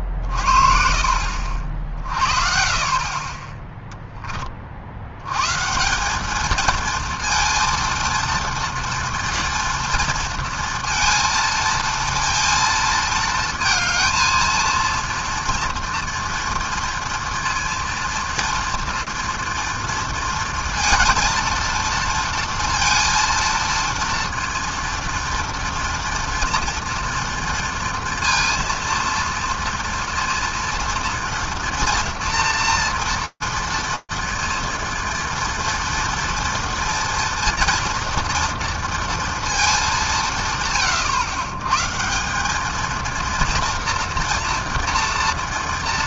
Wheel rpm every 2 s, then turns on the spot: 40, 50, 30, 220, 230, 230, 230, 230, 230, 230, 230, 230, 230, 230, 230, 230, 230, 230, 240, 230, 130, 210, 230.
none